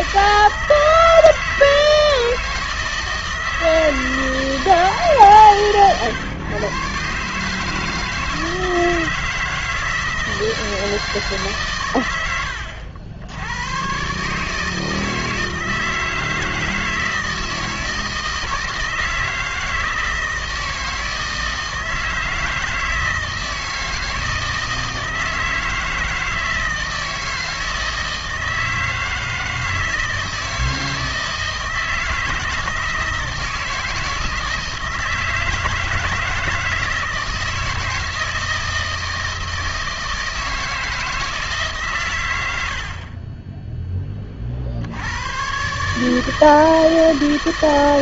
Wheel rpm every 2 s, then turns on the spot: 160, 160, 160, 130, 160, 160, 90, 160, 160, 160, 160, 160, 160, 160, 160, 160, 160, 160, 160, 160, 160, 80, 60, 160.
none